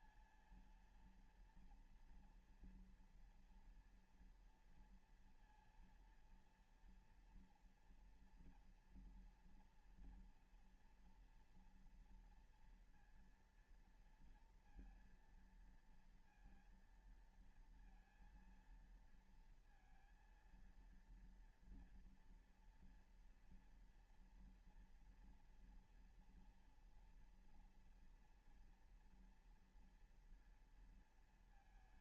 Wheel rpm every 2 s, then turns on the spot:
220, 240, 240, 230, 230, 240, 230, 230, 230, 230, 230, 230, 230, 230, 230, 230.
none